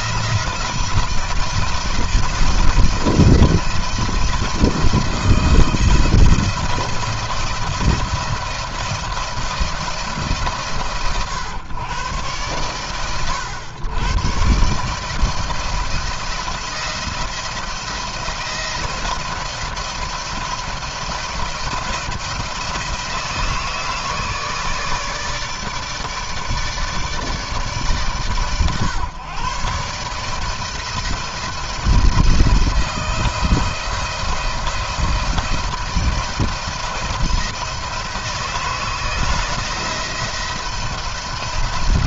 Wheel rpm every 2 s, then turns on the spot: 170, 170, 170, 170, 170, 140, 100, 140, 170, 170, 170, 160, 160, 150, 130, 160, 170, 170, 170, 170, 170.
none